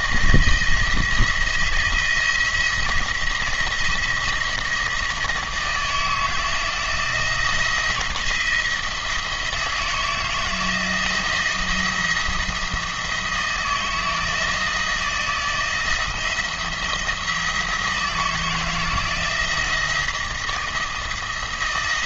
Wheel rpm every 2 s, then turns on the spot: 170, 170, 170, 160, 170, 160, 170, 160, 170, 160, 160.
none